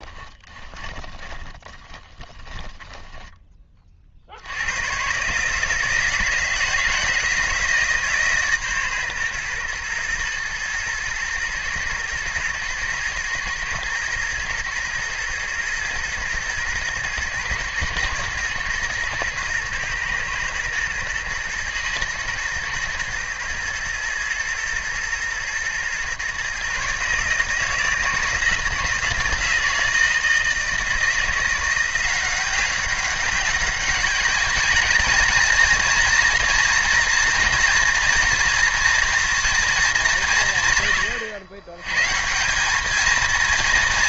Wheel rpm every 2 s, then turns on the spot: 20, 10, 100, 160, 140, 120, 120, 120, 110, 120, 120, 120, 110, 140, 160, 160, 190, 210, 230, 230, 130, 200.
0-4